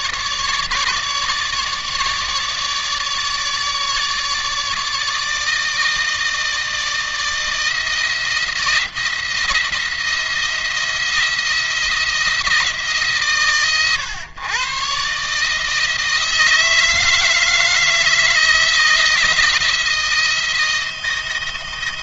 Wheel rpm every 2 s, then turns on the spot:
150, 150, 150, 160, 170, 170, 160, 130, 160, 160, 160.
none